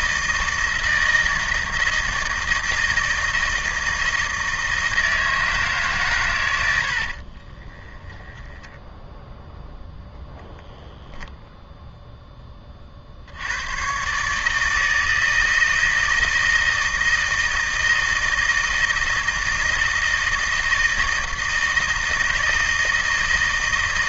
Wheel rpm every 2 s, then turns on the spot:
160, 160, 160, 90, 10, 0, 20, 160, 160, 160, 160, 160.
8-10